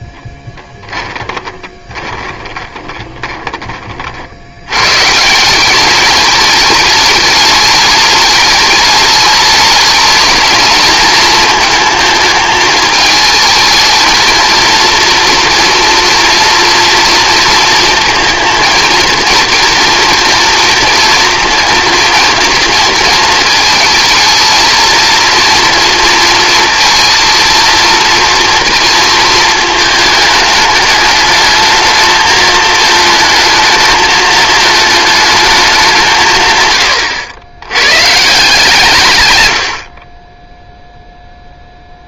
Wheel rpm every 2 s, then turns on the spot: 10, 20, 140, 210, 210, 220, 220, 240, 230, 230, 230, 230, 230, 230, 230, 210, 220, 220, 100, 130, 0.
0-4